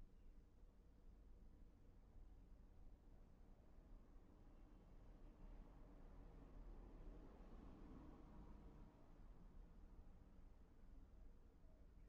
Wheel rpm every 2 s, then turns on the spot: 0, 0, 0, 0, 0, 0.
none